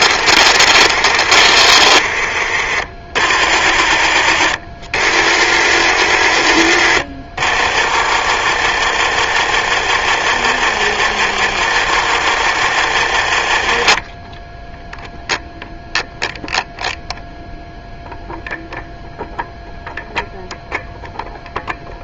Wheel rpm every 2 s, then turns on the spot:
60, 30, 60, 60, 60, 60, 60, 0, 0, 0, 0.
0-2 8-14